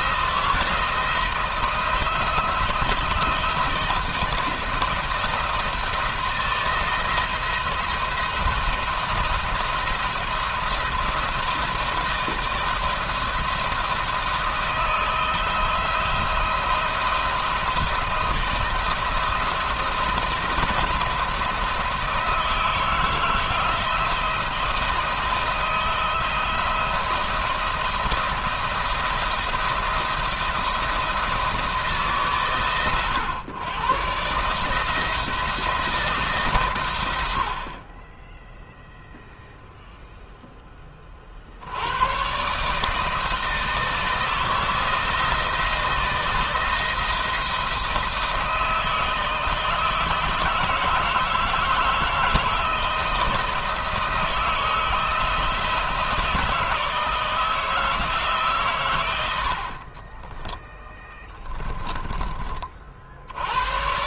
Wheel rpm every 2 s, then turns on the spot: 160, 160, 170, 170, 170, 170, 170, 160, 170, 170, 170, 160, 160, 170, 170, 170, 130, 160, 120, 0, 10, 140, 160, 170, 170, 160, 160, 160, 160, 120, 10, 40.
none